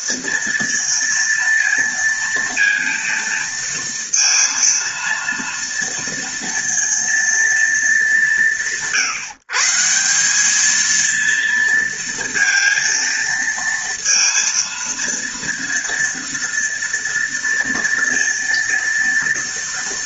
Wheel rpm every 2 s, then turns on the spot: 230, 230, 230, 230, 140, 220, 230, 230, 230, 230.
none